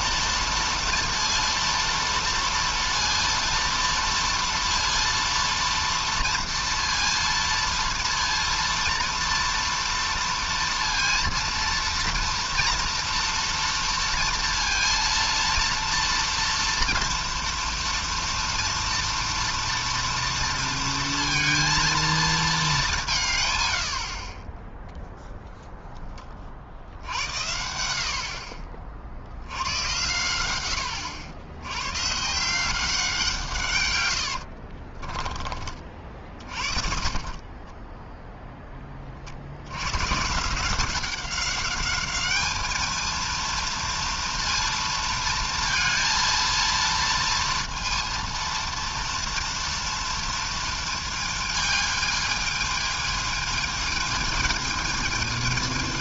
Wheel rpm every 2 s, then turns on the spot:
230, 230, 230, 230, 240, 230, 230, 230, 230, 230, 230, 220, 20, 30, 60, 110, 170, 70, 40, 10, 160, 210, 230, 230, 230, 230, 220, 220.
34-38